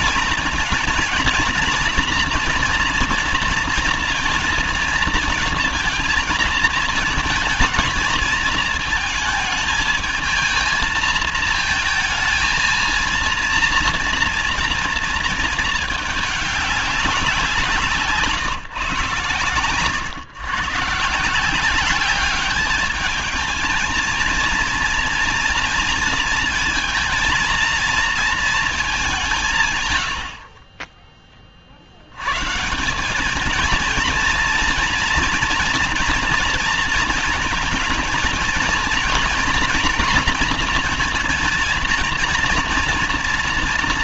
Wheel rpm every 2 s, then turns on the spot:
230, 240, 230, 220, 220, 220, 230, 230, 200, 130, 130, 210, 240, 230, 220, 40, 130, 230, 230, 230, 230, 230.
none